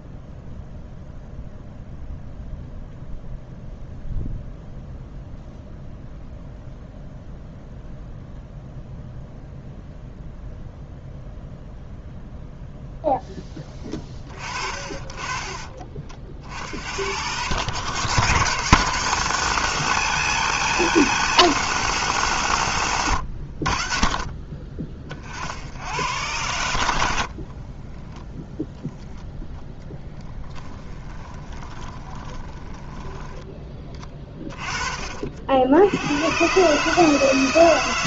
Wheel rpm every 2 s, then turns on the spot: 0, 0, 0, 0, 0, 0, 0, 40, 80, 150, 180, 140, 30, 90, 0, 10, 10, 20, 130.
30-34